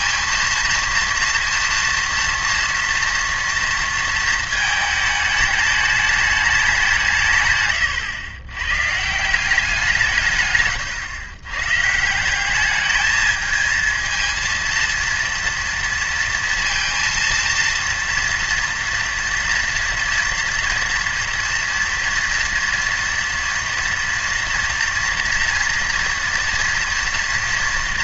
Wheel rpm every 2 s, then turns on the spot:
230, 230, 220, 190, 120, 140, 200, 230, 230, 230, 230, 230, 230, 230.
none